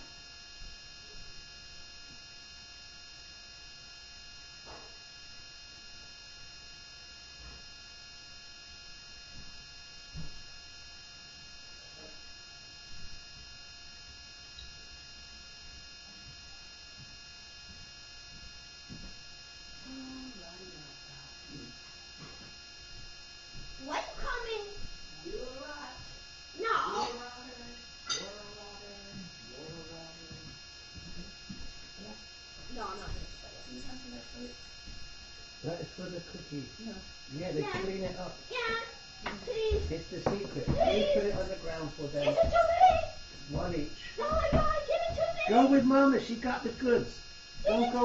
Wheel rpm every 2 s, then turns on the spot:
0, 0, 0, 0, 0, 0, 0, 0, 0, 0, 0, 0, 0, 0, 0, 0, 0, 0, 0, 0, 0, 0, 0, 0.
none